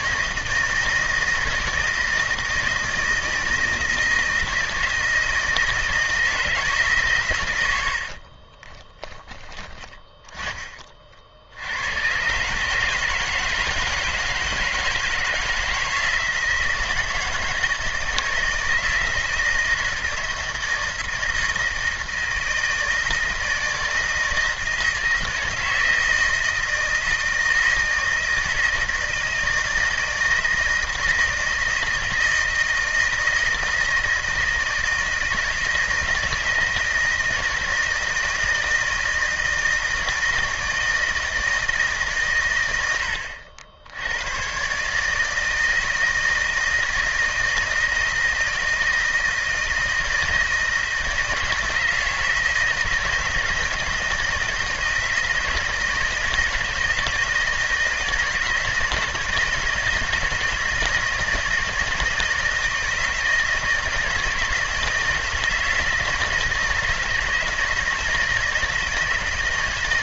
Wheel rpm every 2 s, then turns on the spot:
160, 160, 160, 160, 30, 30, 140, 160, 160, 160, 160, 160, 160, 160, 160, 160, 160, 160, 160, 160, 160, 110, 130, 160, 160, 160, 160, 160, 160, 160, 160, 160, 160, 160, 160.
8-10